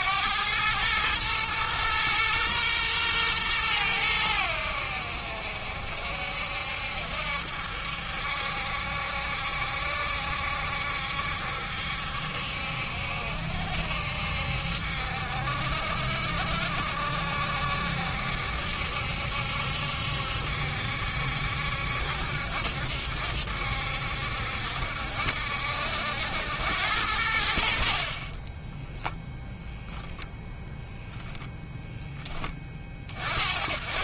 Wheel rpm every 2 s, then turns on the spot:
110, 120, 80, 70, 70, 70, 70, 60, 60, 70, 70, 70, 70, 90, 10, 0, 30.
28-30